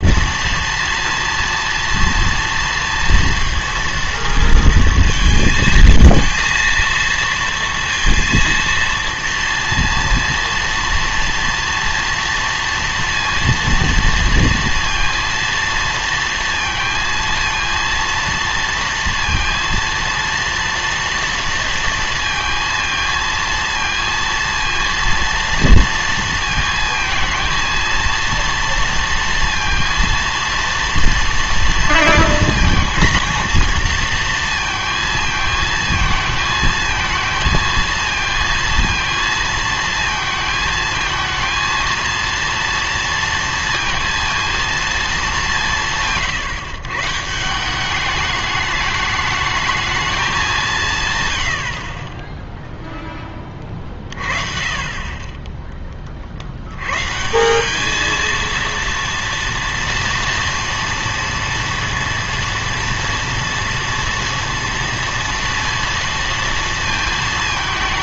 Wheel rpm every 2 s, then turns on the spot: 230, 230, 230, 230, 230, 230, 230, 230, 230, 230, 230, 230, 230, 230, 230, 230, 220, 230, 220, 230, 220, 230, 230, 140, 210, 170, 0, 40, 90, 230, 230, 230, 230, 230.
none